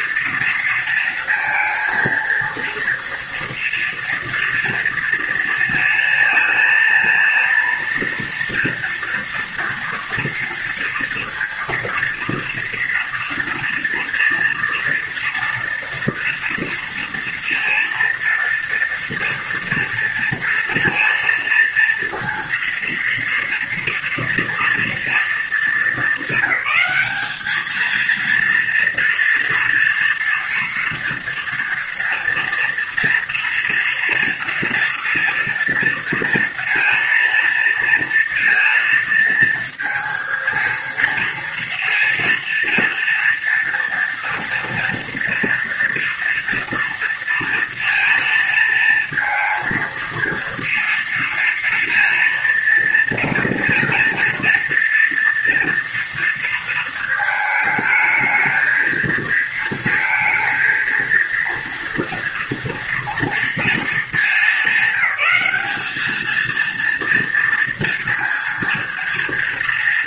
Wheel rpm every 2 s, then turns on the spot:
230, 230, 230, 230, 230, 230, 230, 230, 230, 230, 230, 230, 240, 200, 230, 230, 230, 230, 230, 230, 230, 230, 240, 230, 230, 230, 230, 230, 230, 220, 220, 230, 200, 230, 230.
none